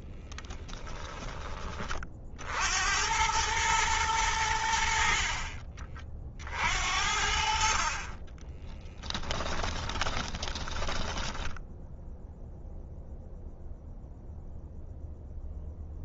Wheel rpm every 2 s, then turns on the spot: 10, 80, 60, 70, 10, 10, 0, 0.
0-2 8-12